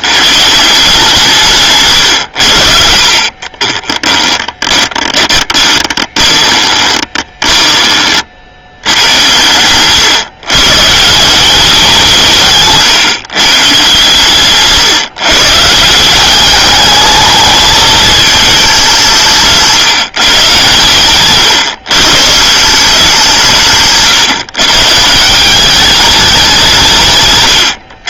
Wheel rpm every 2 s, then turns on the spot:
170, 50, 20, 30, 100, 170, 140, 140, 220, 160, 120, 170, 160, 150.
2-8